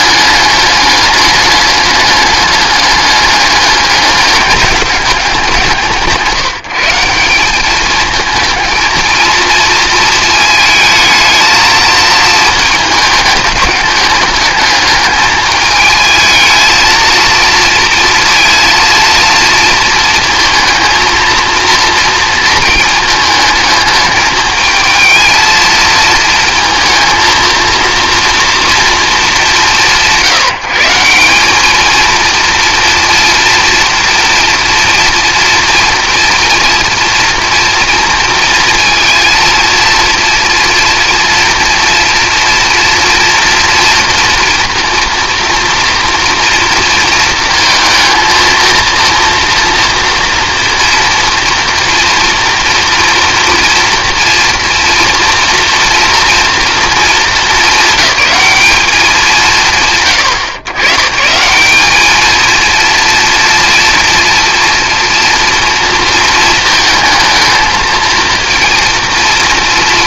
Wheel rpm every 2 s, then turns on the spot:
210, 210, 200, 180, 220, 220, 220, 210, 220, 230, 230, 220, 220, 230, 230, 170, 230, 230, 230, 230, 230, 230, 230, 230, 230, 240, 230, 240, 230, 210, 120, 230, 230, 230, 230.
none